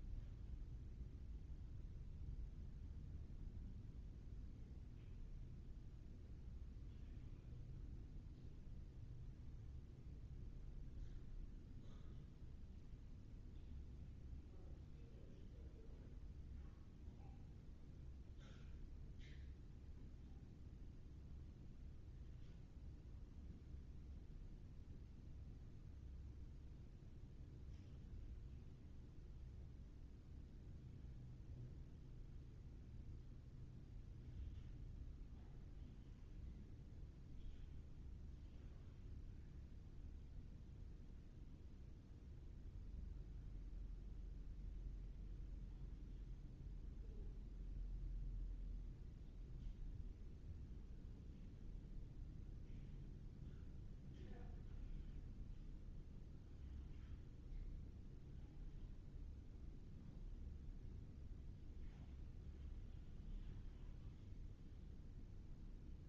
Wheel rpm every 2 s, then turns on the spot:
0, 0, 0, 0, 0, 0, 0, 0, 0, 0, 0, 0, 0, 0, 0, 0, 0, 0, 0, 0, 0, 0, 0, 0, 0, 0, 0, 0, 0, 0, 0, 0, 0.
none